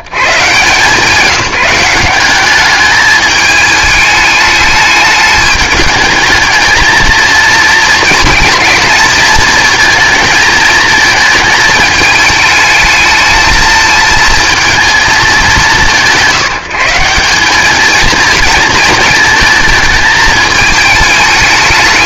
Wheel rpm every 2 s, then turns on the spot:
150, 210, 210, 220, 220, 220, 220, 230, 170, 220, 220.
none